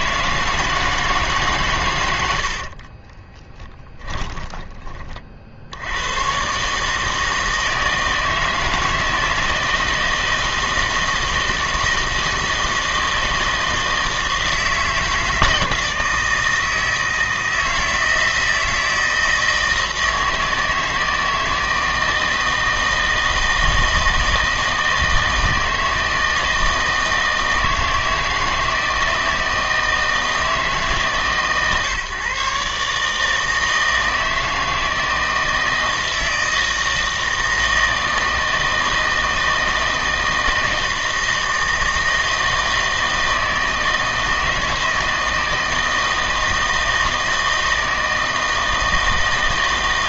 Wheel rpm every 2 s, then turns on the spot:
160, 50, 20, 150, 160, 160, 160, 160, 160, 160, 160, 160, 160, 160, 160, 150, 140, 160, 160, 160, 160, 160, 160, 160, 160.
2-4